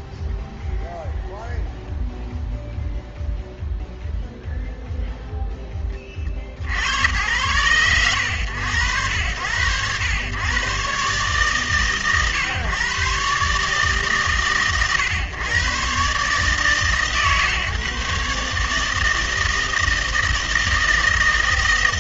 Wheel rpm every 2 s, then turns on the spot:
0, 0, 0, 70, 90, 110, 130, 130, 150, 150, 160.
none